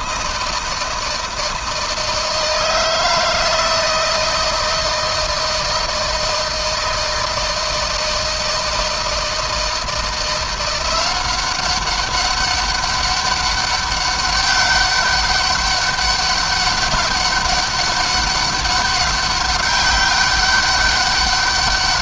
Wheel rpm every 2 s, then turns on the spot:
160, 160, 160, 160, 160, 180, 200, 200, 200, 190, 200.
none